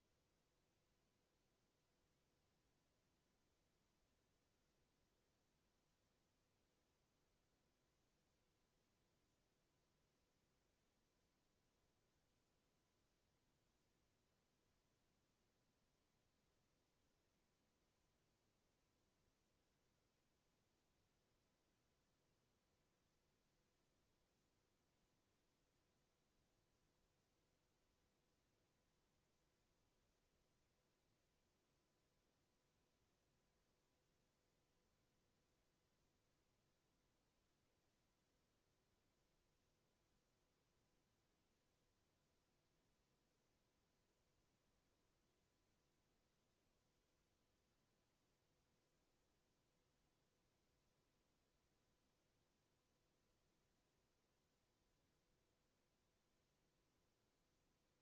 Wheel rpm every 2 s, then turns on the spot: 0, 0, 0, 0, 0, 0, 0, 0, 0, 0, 0, 0, 0, 0, 0, 0, 0, 0, 0, 0, 0, 0, 0, 0, 0, 0, 0, 0, 0.
none